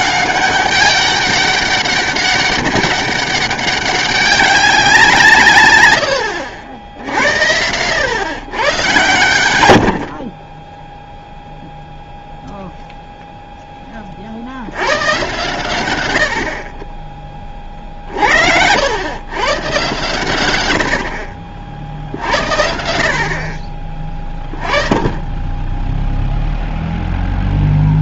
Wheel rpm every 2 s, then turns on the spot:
200, 200, 190, 80, 120, 10, 0, 90, 40, 80, 90, 70, 30, 0.
10-12